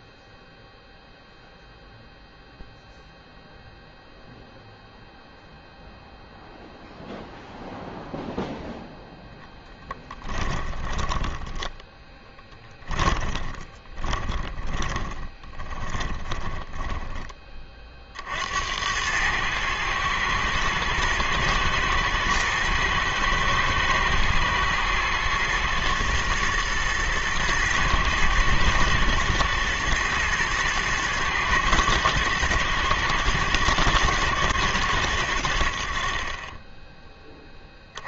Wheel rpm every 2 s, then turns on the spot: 0, 0, 0, 0, 0, 20, 10, 20, 10, 80, 110, 110, 120, 120, 110, 110, 110, 110, 10.
10-18